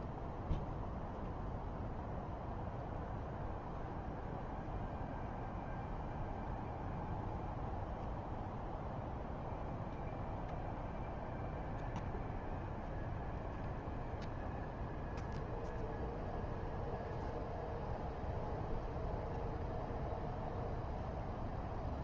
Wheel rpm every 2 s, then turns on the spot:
0, 0, 0, 0, 0, 0, 0, 0, 0, 0, 0.
none